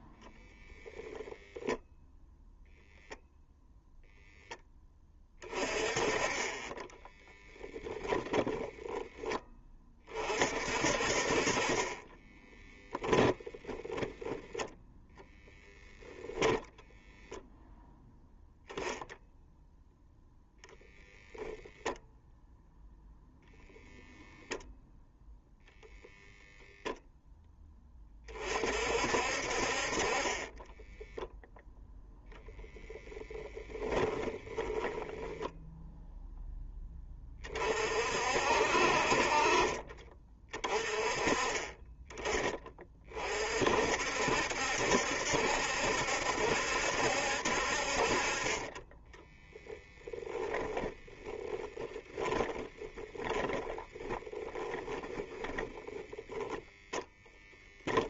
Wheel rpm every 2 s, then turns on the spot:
20, 0, 20, 10, 10, 50, 0, 0, 0, 0, 0, 0, 0, 0, 50, 10, 10, 10, 20, 50, 30, 30, 70, 70, 20, 10, 10, 10, 0.
0-2 6-10 30-32 50-56